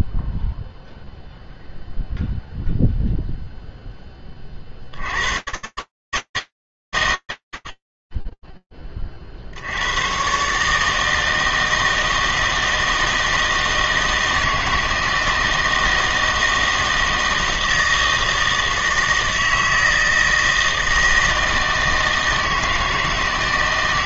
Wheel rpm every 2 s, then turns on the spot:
0, 0, 60, 140, 0, 120, 160, 160, 160, 160, 160, 160.
none